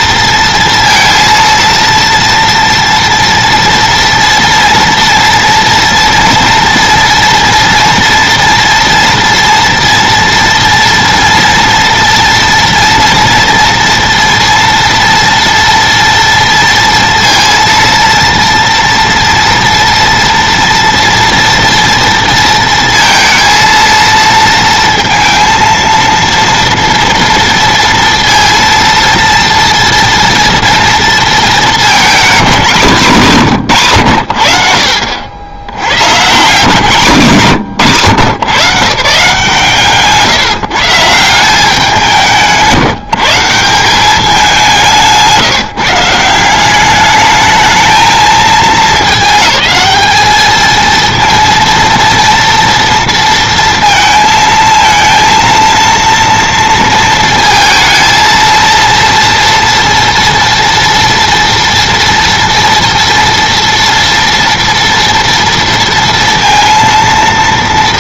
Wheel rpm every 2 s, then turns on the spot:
230, 240, 230, 230, 230, 230, 230, 230, 230, 230, 230, 230, 230, 230, 230, 230, 210, 60, 160, 150, 150, 170, 180, 190, 220, 220, 230, 230, 230, 230, 230, 230, 230, 230.
none